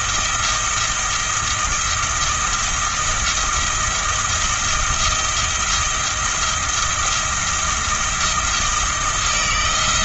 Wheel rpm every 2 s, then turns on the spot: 170, 170, 170, 170, 160.
none